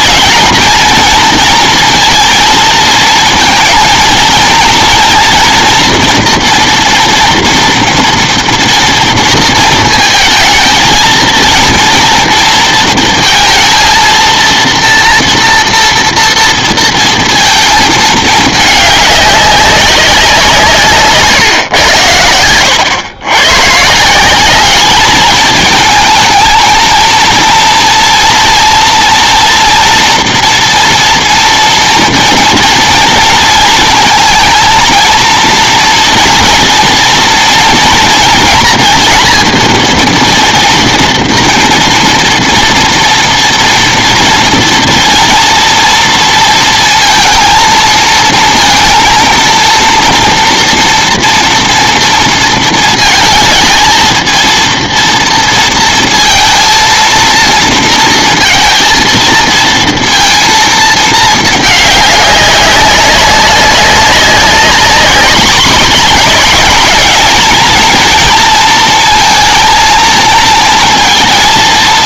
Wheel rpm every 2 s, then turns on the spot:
220, 230, 230, 230, 230, 230, 230, 230, 230, 210, 160, 90, 210, 220, 230, 240, 230, 230, 240, 230, 230, 230, 230, 230, 230, 240, 230, 230, 230, 230, 230, 200, 200, 210, 230, 230.
none